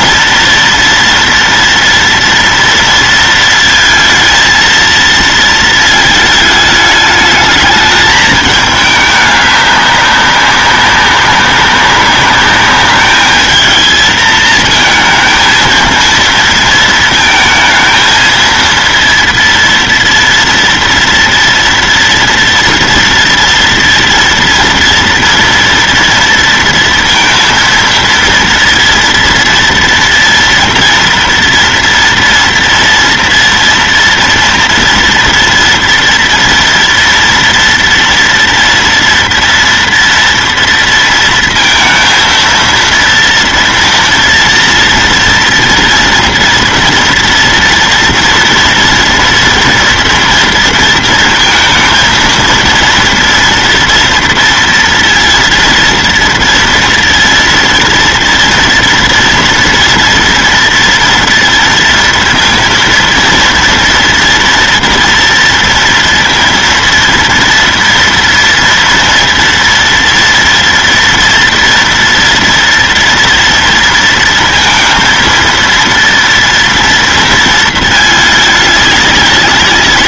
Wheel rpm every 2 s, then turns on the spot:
230, 230, 230, 210, 210, 200, 210, 220, 230, 230, 230, 230, 230, 230, 230, 230, 230, 230, 230, 230, 230, 230, 230, 240, 230, 230, 230, 230, 230, 240, 230, 230, 230, 230, 230, 240, 230, 230, 230, 210.
none